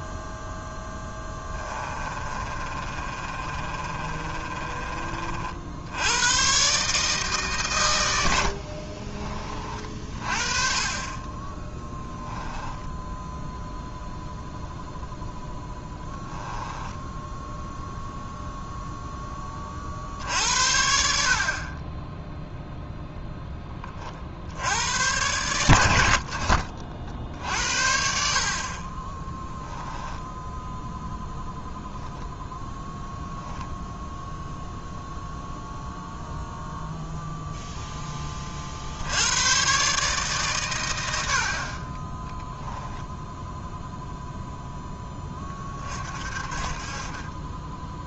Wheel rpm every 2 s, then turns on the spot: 10, 30, 30, 140, 60, 40, 0, 0, 10, 0, 70, 0, 90, 50, 40, 10, 10, 0, 0, 50, 120, 0, 10, 40.
0-6 8-10 16-18